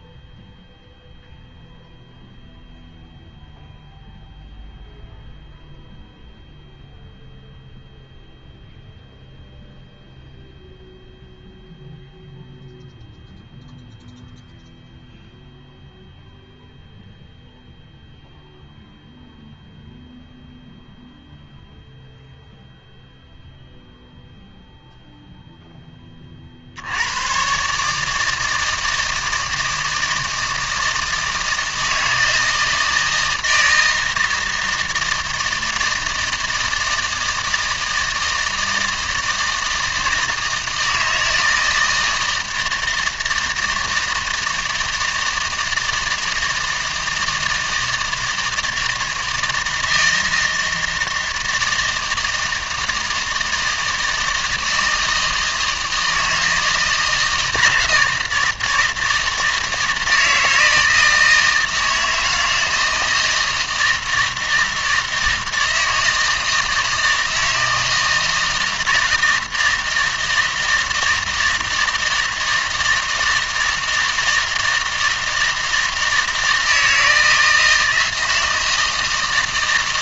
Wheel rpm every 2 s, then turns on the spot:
0, 0, 0, 0, 0, 0, 0, 0, 0, 0, 0, 0, 0, 70, 160, 160, 160, 160, 160, 160, 160, 170, 160, 160, 160, 160, 160, 160, 160, 160, 160, 160, 160, 160, 160, 160, 160, 160, 160, 160.
none